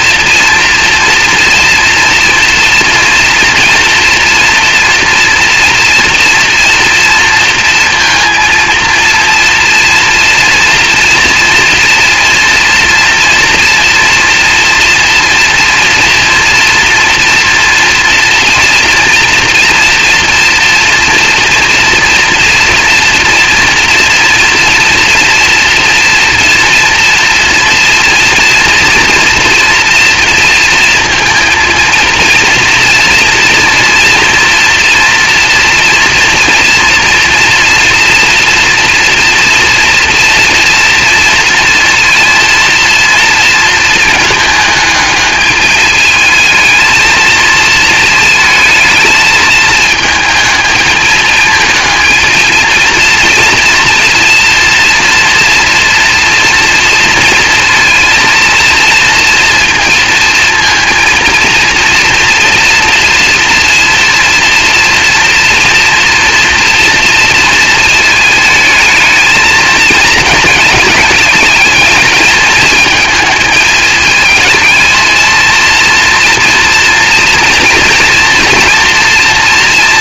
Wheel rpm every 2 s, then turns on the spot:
230, 230, 240, 230, 230, 230, 230, 230, 230, 230, 230, 230, 230, 230, 230, 230, 230, 230, 230, 230, 230, 240, 210, 220, 220, 220, 230, 230, 230, 230, 230, 230, 240, 230, 220, 210, 220, 230, 230, 240.
none